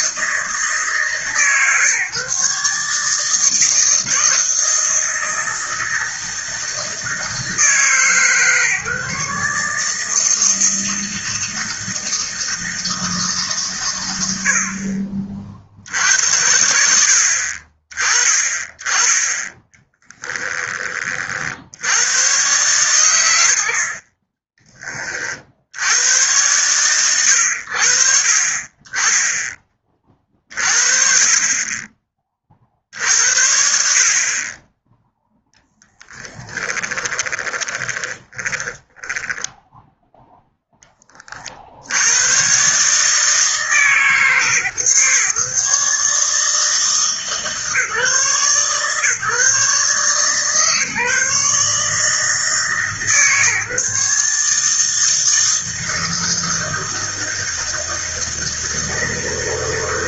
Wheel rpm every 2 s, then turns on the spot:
160, 150, 160, 160, 140, 160, 160, 50, 70, 10, 30, 110, 30, 110, 30, 50, 60, 10, 20, 10, 20, 150, 140, 150, 140, 150, 150, 160, 160, 160.
36-40